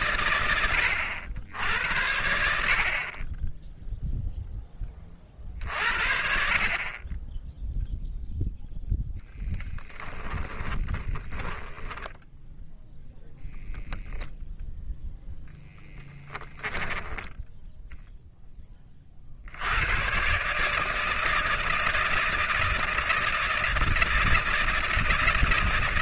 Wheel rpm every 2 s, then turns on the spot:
80, 10, 30, 20, 10, 10, 0, 0, 10, 40, 160, 160, 160.
10-12 16-18